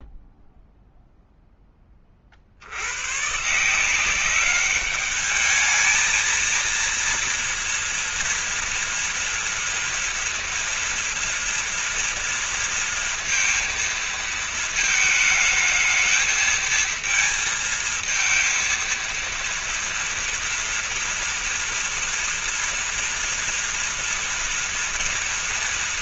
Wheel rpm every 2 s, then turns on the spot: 0, 100, 200, 230, 230, 240, 230, 220, 220, 230, 240, 230, 230.
none